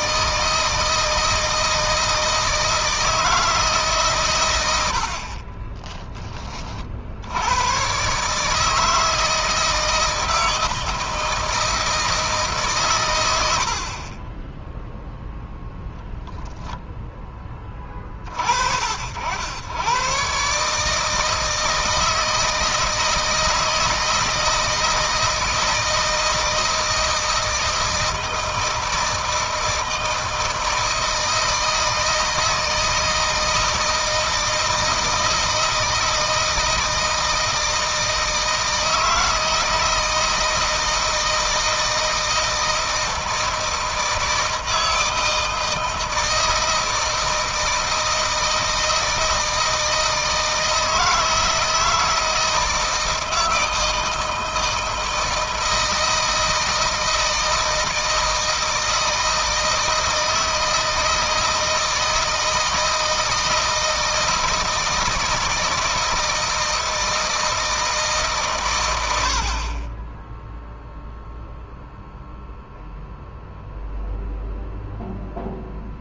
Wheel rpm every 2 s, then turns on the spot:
160, 160, 90, 60, 160, 160, 130, 0, 10, 60, 150, 160, 160, 160, 160, 160, 160, 160, 160, 160, 160, 160, 160, 160, 160, 160, 160, 160, 160, 160, 160, 160, 160, 160, 110, 0, 0, 0.
none